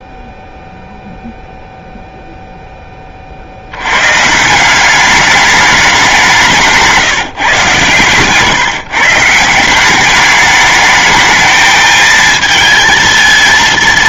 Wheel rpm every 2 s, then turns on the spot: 0, 0, 170, 180, 140, 210, 220.
none